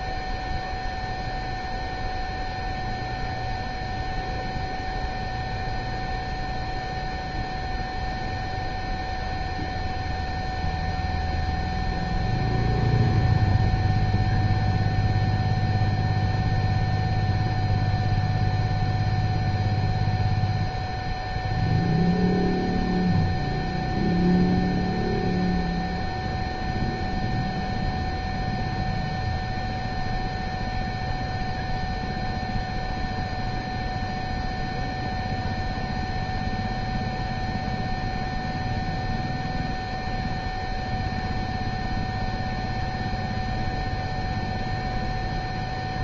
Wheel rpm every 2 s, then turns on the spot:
0, 0, 0, 0, 0, 0, 0, 0, 0, 0, 0, 0, 0, 0, 0, 0, 0, 0, 0, 0, 0, 0, 0.
none